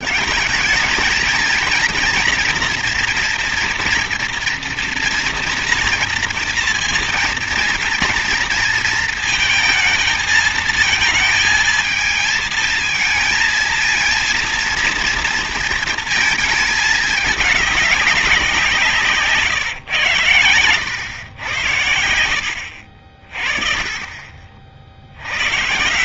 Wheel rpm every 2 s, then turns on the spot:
220, 230, 230, 230, 230, 220, 220, 230, 220, 170, 100, 60, 50.
none